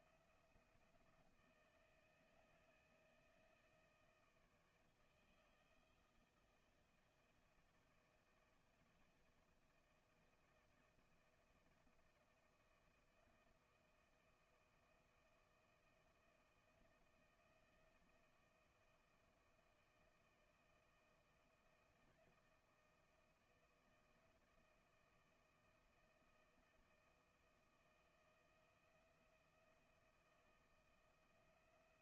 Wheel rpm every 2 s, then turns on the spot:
170, 160, 160, 160, 160, 160, 160, 160, 160, 160, 160, 160, 160, 160, 160, 170.
none